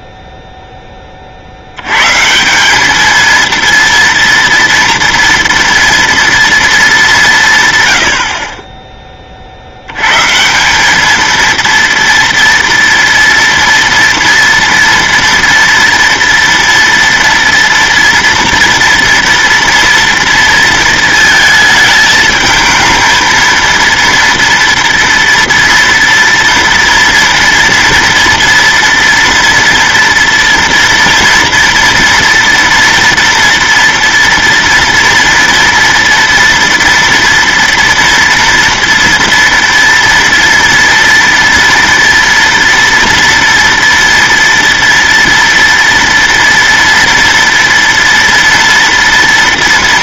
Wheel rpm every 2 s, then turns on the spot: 10, 200, 230, 230, 30, 200, 230, 240, 230, 230, 230, 220, 230, 230, 230, 230, 230, 230, 230, 230, 230, 230, 230, 230, 230.
none